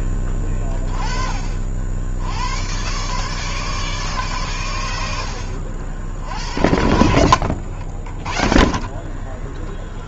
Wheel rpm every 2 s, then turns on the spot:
20, 110, 110, 70, 30.
none